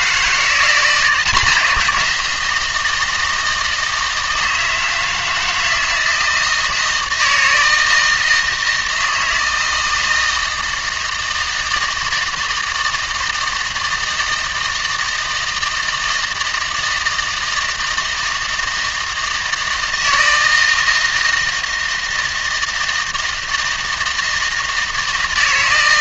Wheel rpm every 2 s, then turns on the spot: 170, 170, 160, 160, 160, 160, 160, 160, 160, 160, 160, 160, 160.
none